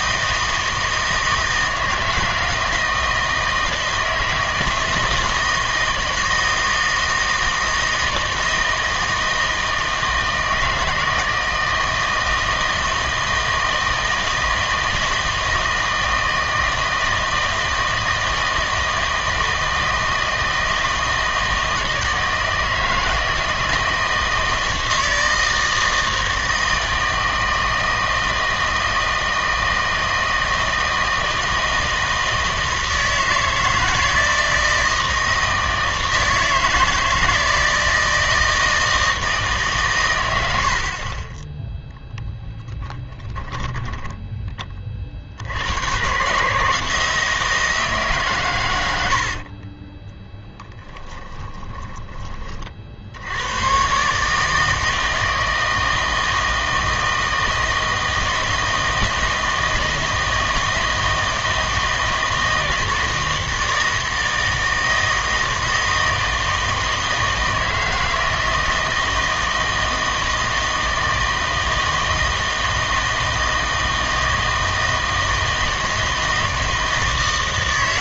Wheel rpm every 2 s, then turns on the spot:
160, 160, 160, 160, 160, 160, 160, 160, 160, 160, 160, 160, 160, 160, 160, 160, 160, 160, 160, 160, 90, 10, 20, 150, 110, 10, 40, 150, 160, 160, 160, 160, 160, 160, 160, 160, 160, 160, 160.
40-44 50-52